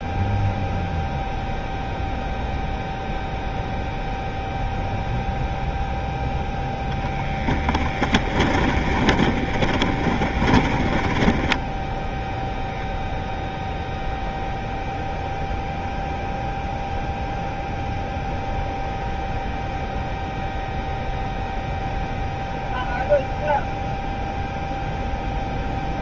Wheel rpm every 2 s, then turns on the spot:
0, 0, 0, 10, 30, 20, 0, 0, 0, 0, 0, 0, 0.
8-12